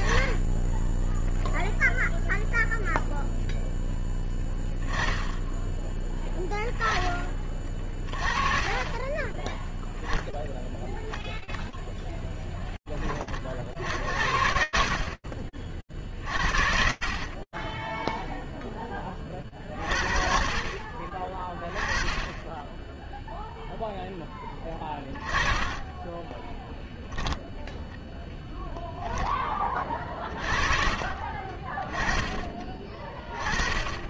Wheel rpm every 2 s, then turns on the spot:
0, 0, 20, 30, 10, 0, 60, 50, 0, 50, 20, 10, 20, 0, 30, 20, 50.
24-26 28-30